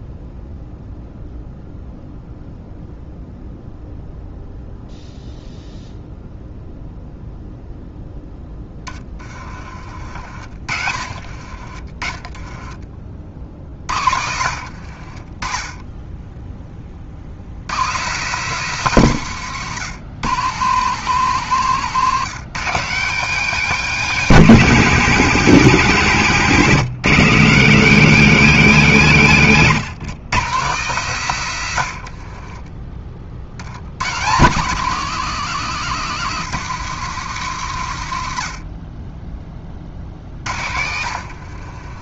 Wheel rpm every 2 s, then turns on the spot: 0, 0, 0, 0, 20, 50, 30, 60, 20, 190, 160, 180, 170, 150, 180, 160, 30, 170, 180, 40, 80.
8-12 14-16 32-34 40-42